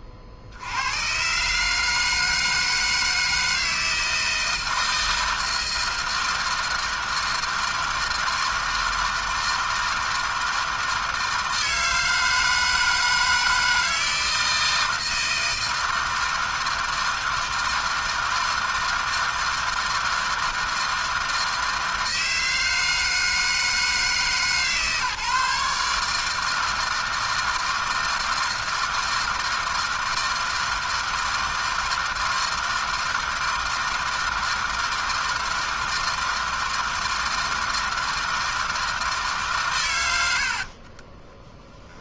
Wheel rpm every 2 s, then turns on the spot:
70, 160, 160, 160, 160, 160, 160, 160, 160, 160, 160, 160, 150, 160, 160, 160, 160, 160, 160, 160, 70.
40-42